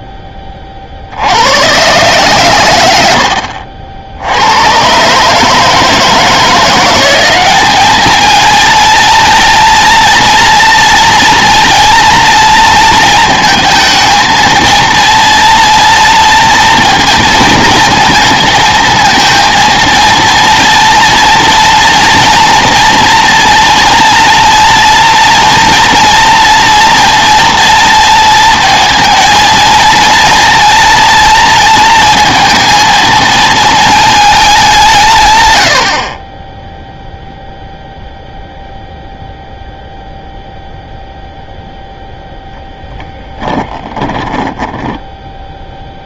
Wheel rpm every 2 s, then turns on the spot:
20, 100, 130, 180, 230, 230, 230, 230, 220, 220, 230, 230, 240, 230, 230, 240, 230, 180, 10, 0, 0, 0, 10.
44-46